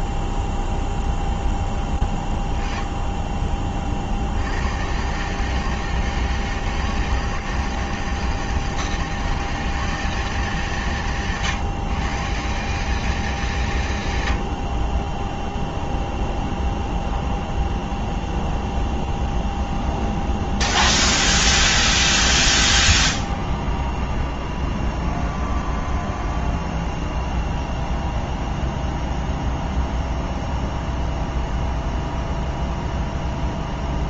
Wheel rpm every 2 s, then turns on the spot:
0, 0, 30, 160, 160, 180, 150, 120, 0, 0, 0, 0, 0, 0, 0, 0, 0.
none